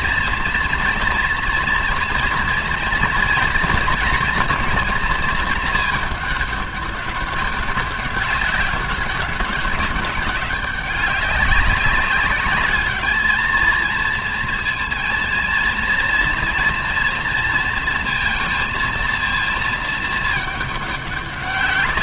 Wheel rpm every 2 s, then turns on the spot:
230, 230, 220, 200, 200, 200, 220, 230, 230, 230, 190.
none